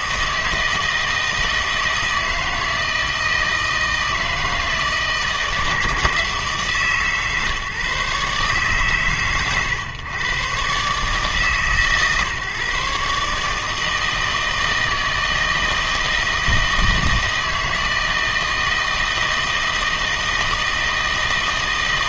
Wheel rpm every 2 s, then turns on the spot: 160, 160, 160, 150, 130, 140, 140, 160, 160, 160, 160.
none